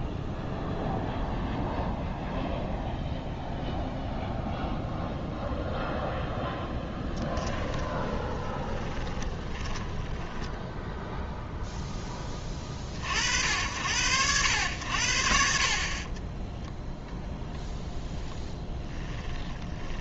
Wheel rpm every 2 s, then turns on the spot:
0, 0, 0, 10, 20, 10, 40, 80, 10, 10.
6-12 18-20